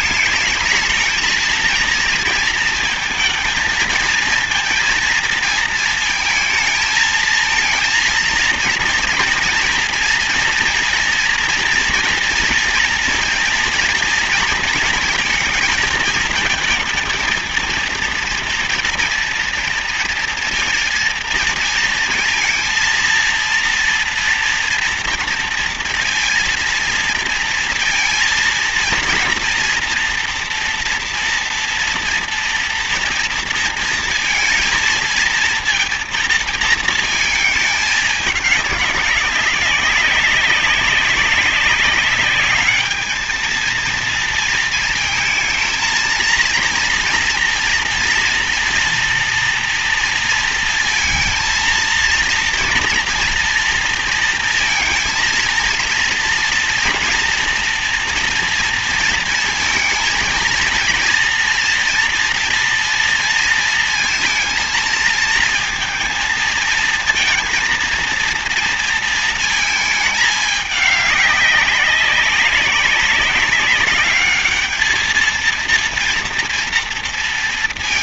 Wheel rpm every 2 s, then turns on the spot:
220, 230, 230, 230, 230, 230, 230, 230, 220, 230, 230, 230, 240, 230, 230, 240, 230, 230, 220, 200, 190, 210, 230, 230, 240, 230, 230, 230, 230, 230, 230, 230, 230, 230, 230, 210, 200, 210, 230.
none